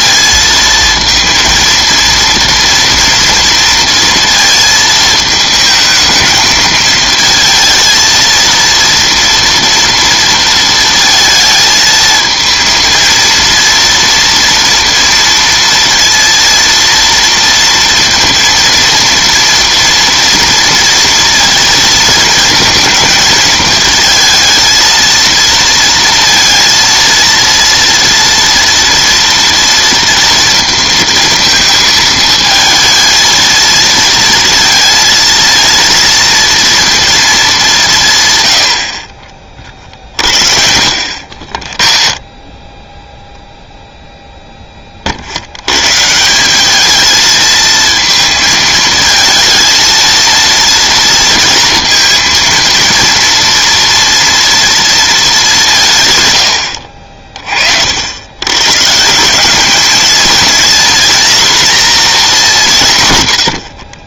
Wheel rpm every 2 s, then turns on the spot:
230, 230, 220, 220, 230, 230, 230, 230, 230, 230, 230, 220, 230, 230, 230, 230, 220, 230, 230, 100, 60, 20, 10, 200, 220, 230, 230, 230, 80, 140, 230, 190.
42-44